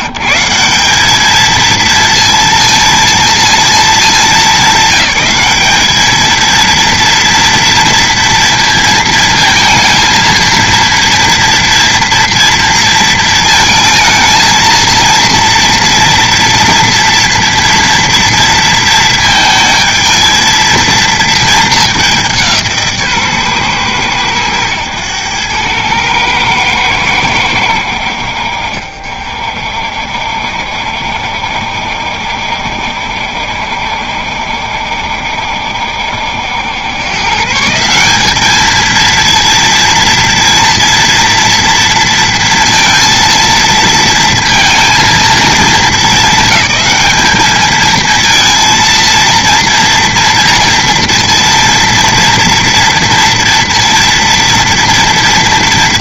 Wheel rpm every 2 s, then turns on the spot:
200, 230, 200, 230, 230, 230, 230, 230, 230, 230, 220, 160, 110, 110, 60, 60, 70, 70, 120, 230, 230, 230, 230, 210, 230, 230, 230, 230.
none